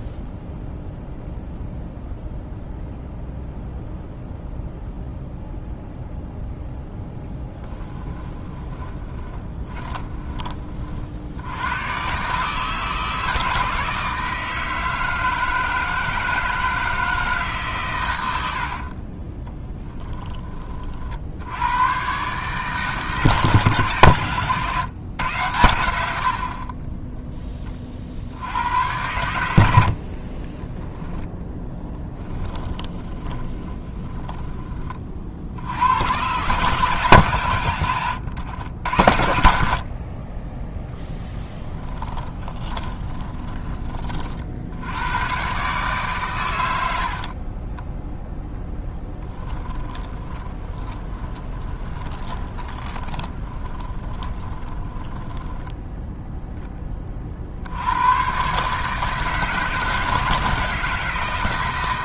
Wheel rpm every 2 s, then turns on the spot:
0, 0, 0, 0, 20, 50, 160, 160, 160, 50, 40, 150, 120, 30, 90, 10, 20, 30, 140, 80, 10, 20, 80, 90, 10, 20, 20, 20, 20, 140, 160.
8-10 18-20 30-34 42-44 48-56